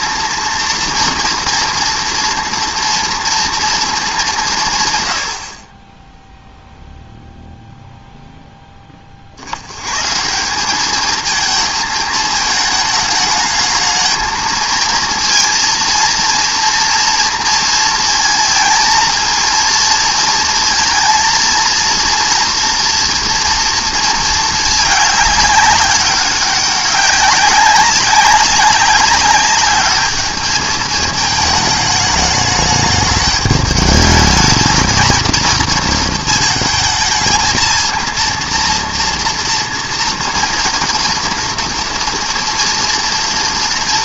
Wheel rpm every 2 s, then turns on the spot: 230, 230, 160, 0, 10, 190, 220, 220, 230, 220, 230, 230, 220, 200, 200, 220, 210, 210, 220, 230, 230, 240.
none